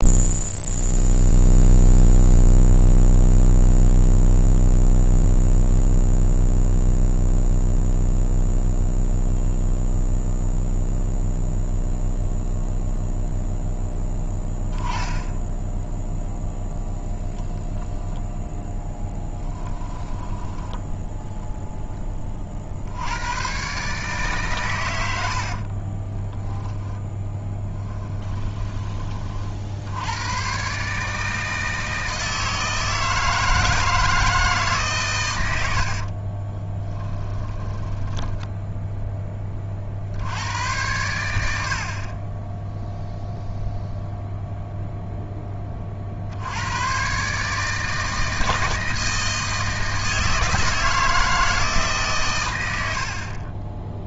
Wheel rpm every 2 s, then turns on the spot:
0, 0, 0, 0, 0, 0, 0, 10, 0, 10, 10, 70, 110, 10, 20, 140, 160, 140, 10, 10, 100, 0, 0, 110, 160, 160, 80.
20-22 26-28 36-38